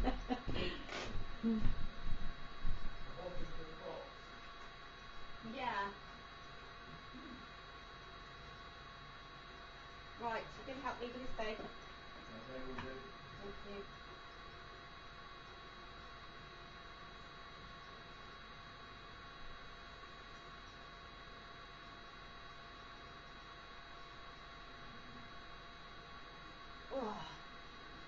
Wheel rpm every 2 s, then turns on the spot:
0, 0, 0, 0, 0, 0, 0, 0, 0, 0, 0, 0, 0, 0.
none